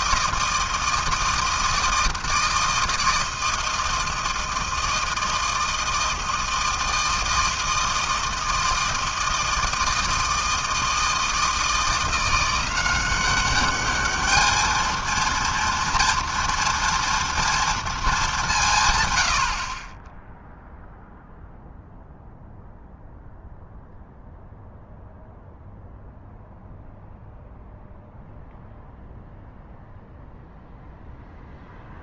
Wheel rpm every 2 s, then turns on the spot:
160, 160, 160, 160, 160, 160, 180, 220, 230, 180, 0, 0, 0, 0, 0, 0.
none